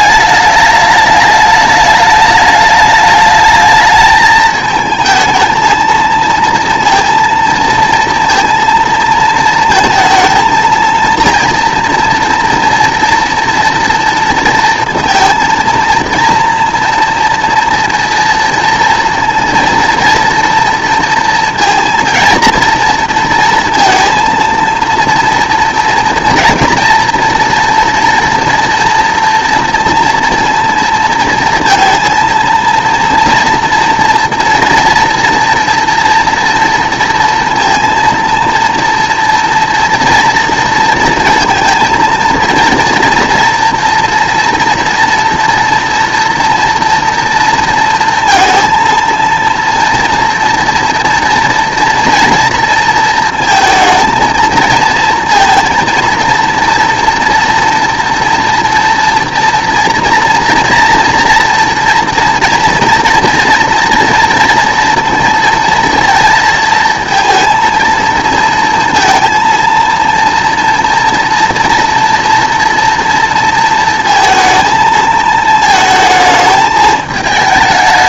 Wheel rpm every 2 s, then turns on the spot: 210, 210, 220, 230, 230, 230, 230, 230, 230, 230, 230, 230, 230, 240, 230, 230, 230, 230, 230, 230, 230, 230, 240, 240, 230, 230, 230, 230, 230, 230, 230, 230, 230, 230, 230, 230, 230, 220, 220.
none